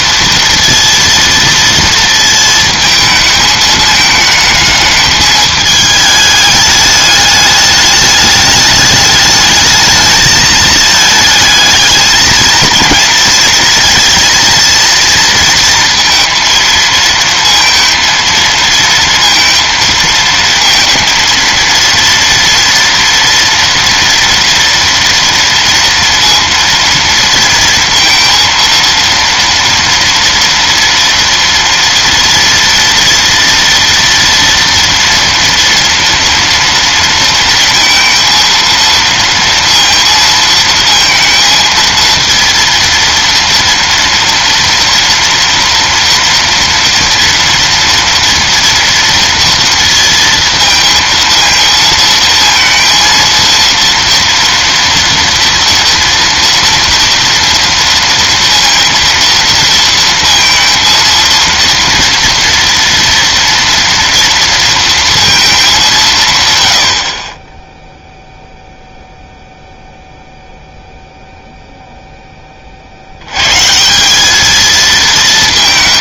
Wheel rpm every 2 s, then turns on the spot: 230, 220, 220, 210, 210, 220, 220, 230, 230, 230, 220, 230, 230, 230, 230, 240, 230, 230, 230, 230, 230, 230, 230, 230, 230, 230, 230, 230, 230, 230, 230, 230, 230, 90, 0, 0, 20, 220.
none